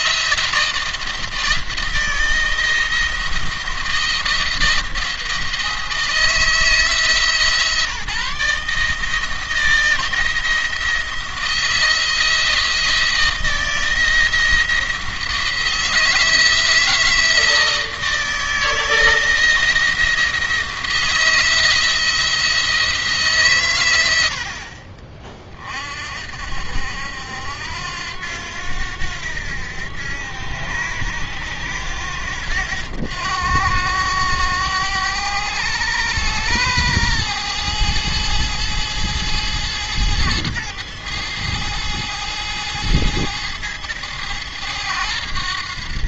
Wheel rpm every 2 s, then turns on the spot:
170, 170, 170, 160, 160, 170, 160, 170, 160, 160, 160, 170, 70, 70, 80, 90, 90, 100, 110, 110, 110, 110, 100.
none